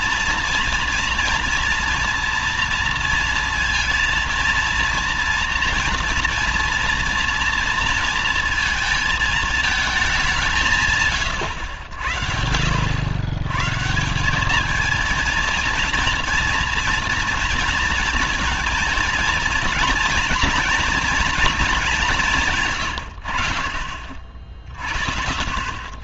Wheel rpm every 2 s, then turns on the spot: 240, 230, 230, 230, 230, 160, 60, 210, 230, 230, 230, 120, 70.
none